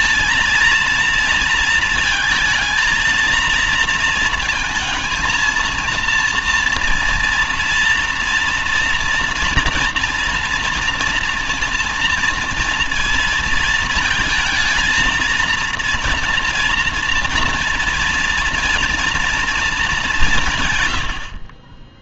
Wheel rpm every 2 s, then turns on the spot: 230, 220, 230, 240, 230, 230, 230, 230, 230, 230, 120.
none